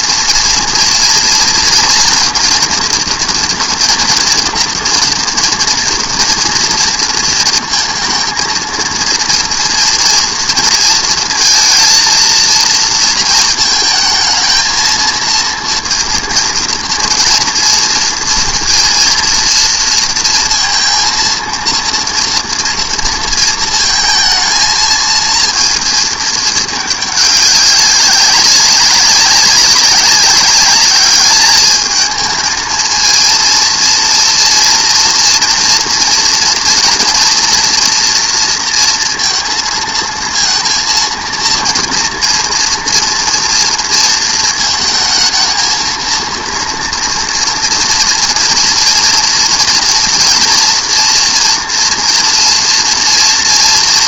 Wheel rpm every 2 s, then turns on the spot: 230, 230, 230, 230, 230, 230, 230, 220, 230, 230, 230, 230, 220, 210, 200, 200, 220, 240, 240, 230, 230, 230, 220, 230, 230, 230, 240.
none